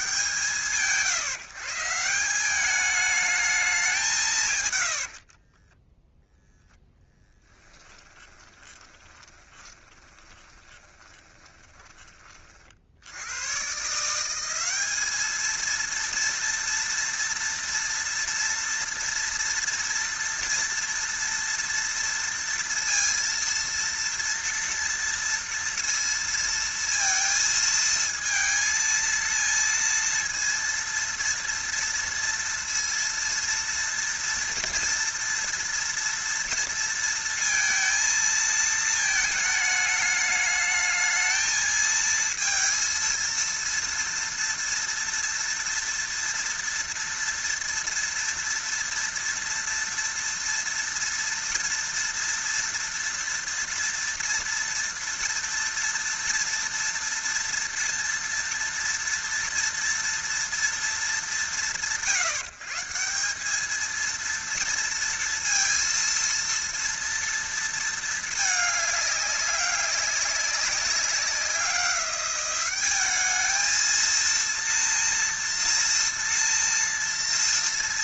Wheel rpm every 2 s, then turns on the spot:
150, 210, 110, 0, 20, 20, 50, 200, 230, 230, 230, 230, 230, 230, 230, 230, 230, 230, 230, 220, 220, 230, 230, 230, 230, 230, 230, 230, 230, 230, 200, 170, 230, 230, 210, 190, 200, 230, 230.
4-6 8-12